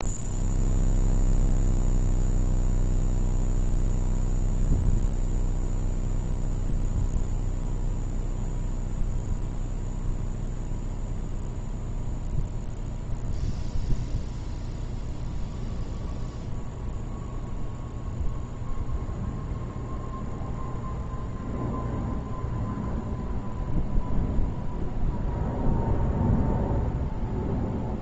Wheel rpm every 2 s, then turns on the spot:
0, 0, 0, 0, 0, 0, 0, 0, 0, 0, 0, 0, 0, 0.
none